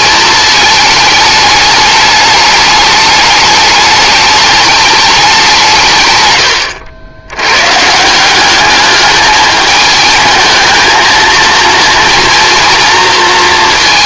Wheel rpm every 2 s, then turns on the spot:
210, 210, 210, 80, 200, 220, 230.
none